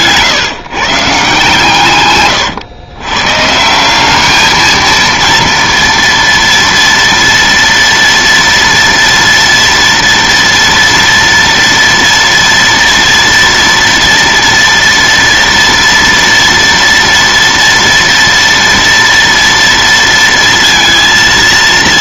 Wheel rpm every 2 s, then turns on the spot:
150, 120, 220, 230, 230, 230, 230, 230, 230, 230, 230.
none